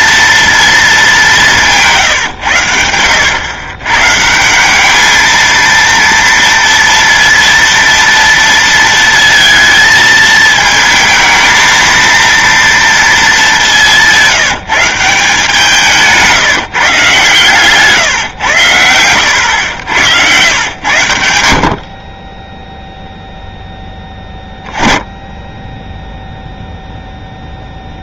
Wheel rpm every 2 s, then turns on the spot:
230, 100, 190, 230, 230, 220, 230, 170, 160, 120, 110, 10, 10, 0.
none